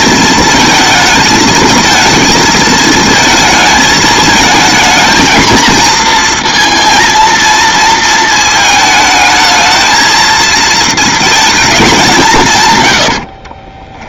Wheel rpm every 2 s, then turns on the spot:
230, 220, 220, 230, 220, 230, 140.
12-14